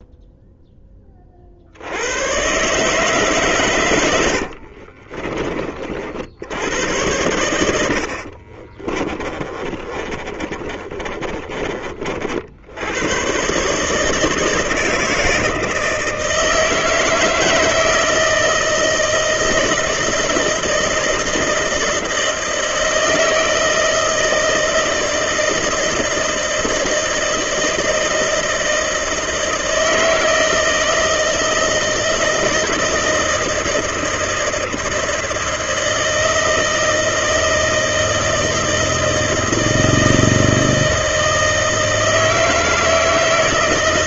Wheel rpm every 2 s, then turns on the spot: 0, 130, 60, 80, 40, 30, 70, 160, 160, 160, 160, 160, 160, 160, 160, 160, 160, 160, 160, 160, 160, 160.
4-6 8-12